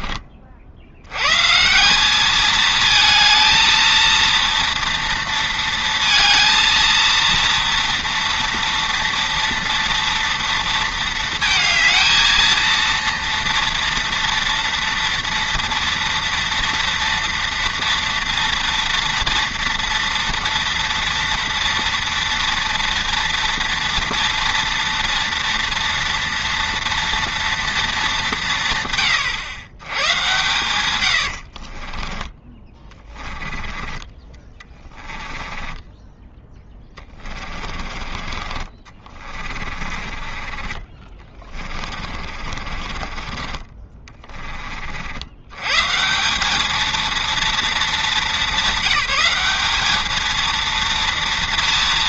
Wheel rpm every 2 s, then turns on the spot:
60, 220, 230, 230, 230, 230, 230, 230, 230, 230, 230, 230, 230, 230, 160, 120, 20, 20, 10, 50, 30, 40, 40, 220, 200, 230.
34-40 42-44